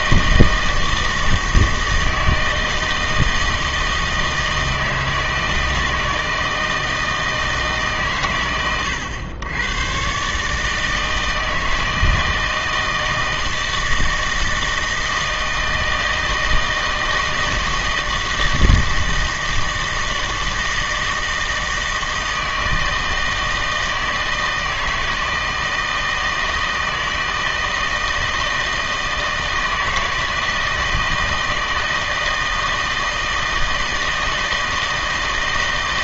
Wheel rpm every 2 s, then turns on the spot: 160, 160, 160, 160, 110, 150, 160, 160, 160, 160, 160, 160, 160, 160, 160, 160, 160, 160.
none